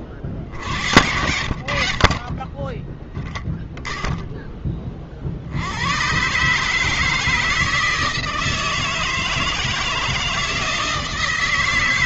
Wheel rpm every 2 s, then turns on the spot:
90, 30, 10, 140, 160, 160.
0-4